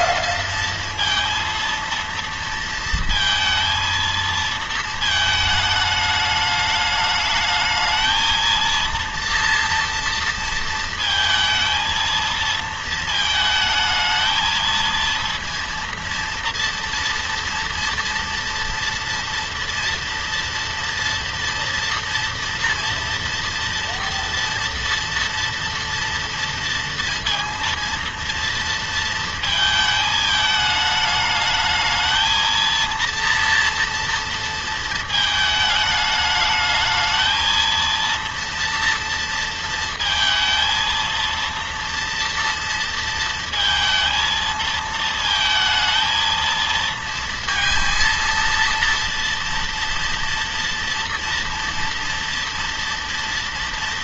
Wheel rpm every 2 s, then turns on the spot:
230, 230, 220, 210, 230, 230, 220, 220, 230, 230, 230, 230, 230, 230, 230, 210, 220, 230, 220, 230, 230, 230, 220, 230, 230, 230, 230.
none